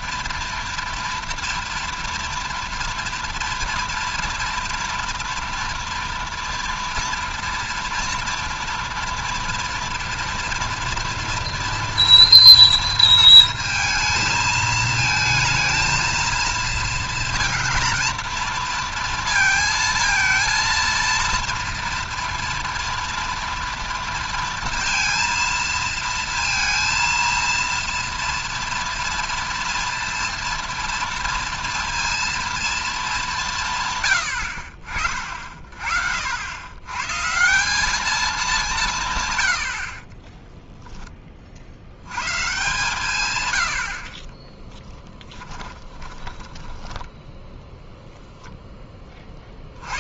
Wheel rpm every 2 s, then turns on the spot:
230, 240, 230, 230, 230, 230, 230, 230, 230, 230, 230, 230, 230, 230, 230, 230, 230, 70, 90, 200, 10, 150, 20, 20, 0.
44-48